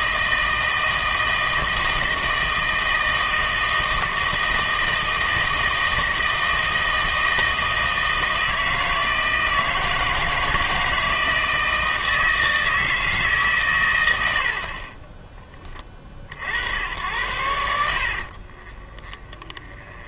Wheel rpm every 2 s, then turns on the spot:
160, 160, 160, 160, 160, 160, 160, 50, 70, 40.
18-20